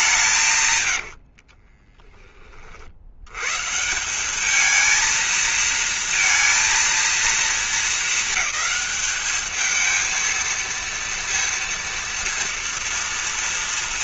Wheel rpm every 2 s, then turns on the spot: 150, 30, 210, 230, 220, 220, 230.
0-2